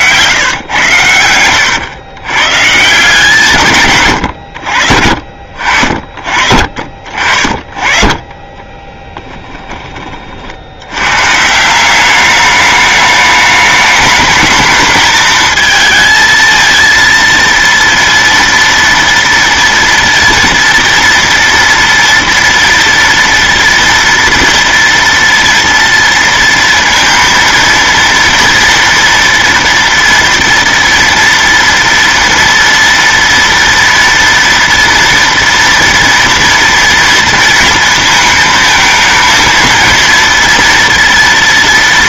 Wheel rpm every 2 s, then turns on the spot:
110, 130, 100, 50, 20, 60, 210, 210, 230, 230, 230, 230, 230, 230, 230, 230, 230, 230, 230, 230, 230.
8-10